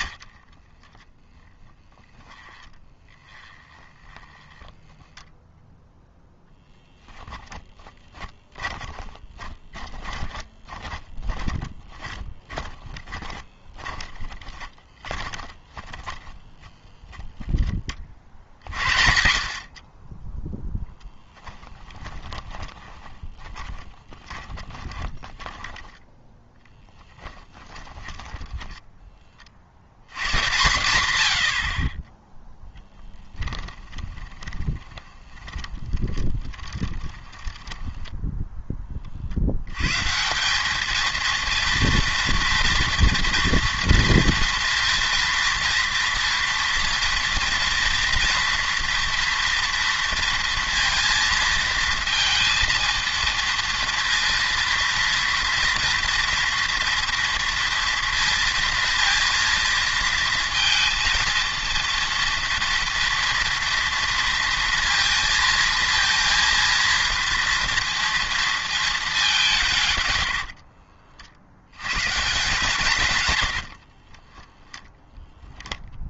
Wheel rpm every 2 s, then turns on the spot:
20, 10, 10, 10, 20, 30, 20, 20, 10, 70, 10, 20, 20, 10, 10, 120, 0, 20, 20, 10, 190, 230, 230, 230, 240, 230, 230, 230, 230, 230, 230, 240, 230, 230, 220, 60, 150, 10.
0-18 22-30 34-38 70-72